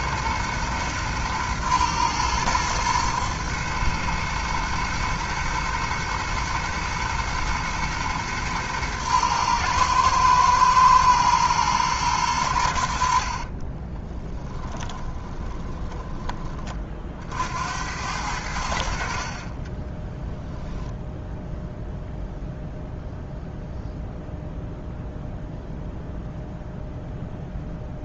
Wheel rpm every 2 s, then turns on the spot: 110, 110, 120, 110, 110, 110, 80, 30, 40, 70, 0, 0, 0, 0.
14-16